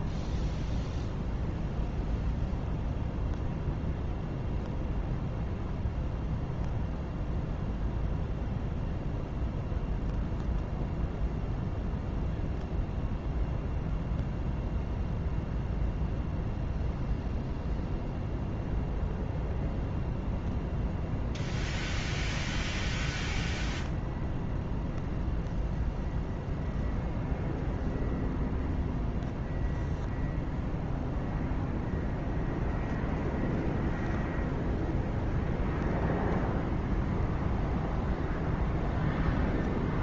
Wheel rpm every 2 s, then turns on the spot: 0, 0, 0, 0, 0, 0, 0, 0, 0, 0, 0, 0, 0, 0, 0, 0, 0, 0, 0, 0.
none